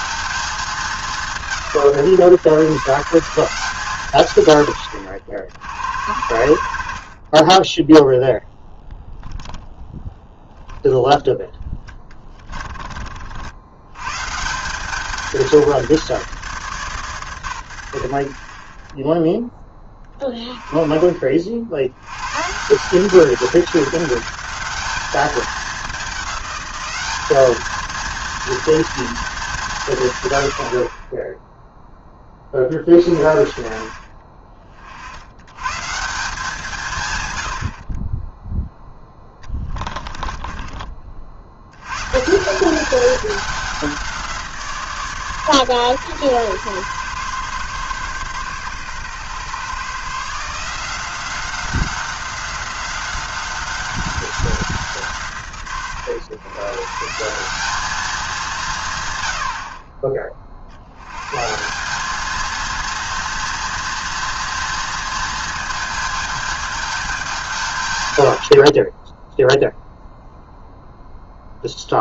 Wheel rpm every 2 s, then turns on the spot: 190, 160, 80, 50, 0, 0, 30, 180, 150, 50, 20, 150, 210, 200, 230, 60, 30, 30, 170, 10, 30, 180, 160, 130, 140, 160, 190, 190, 110, 180, 70, 230, 230, 220, 50, 0.
6-8 12-14 40-42